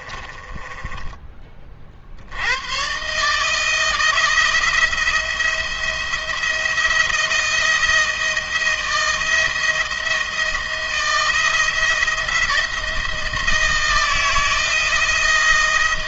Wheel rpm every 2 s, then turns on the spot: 20, 110, 160, 170, 160, 170, 160, 160.
0-2